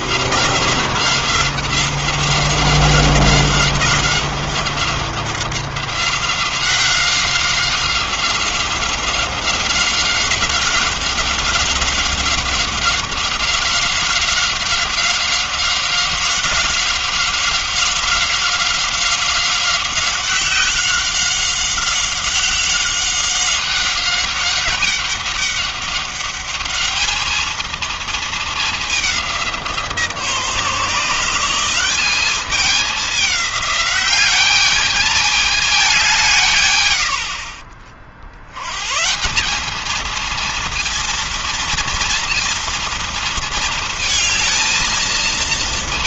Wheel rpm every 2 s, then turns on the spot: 180, 190, 190, 190, 190, 190, 190, 190, 190, 190, 190, 190, 200, 210, 220, 150, 200, 200, 160, 70, 220, 230, 220.
none